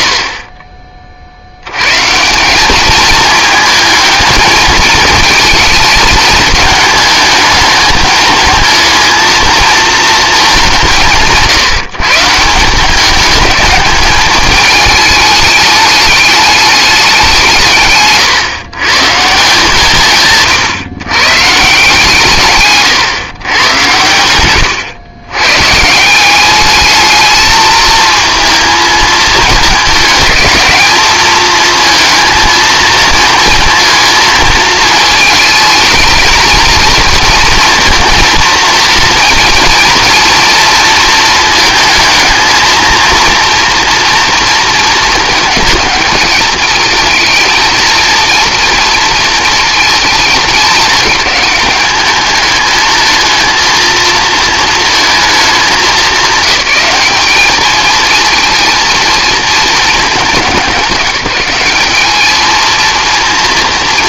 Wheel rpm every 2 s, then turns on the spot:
30, 210, 210, 220, 220, 190, 170, 210, 210, 140, 140, 140, 100, 210, 220, 210, 230, 220, 230, 230, 230, 230, 230, 220, 230, 220, 220, 230, 210, 230, 200, 220.
none